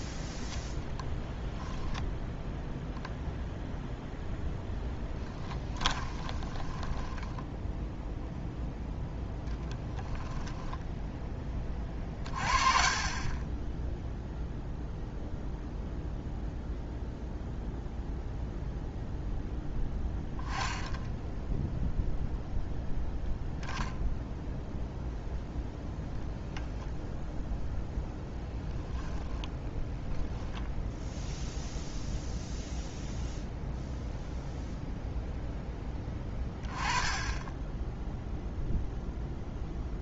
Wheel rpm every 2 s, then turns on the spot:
0, 0, 0, 10, 0, 0, 30, 0, 0, 0, 10, 0, 0, 0, 10, 0, 0, 0, 10, 0.
6-8 20-22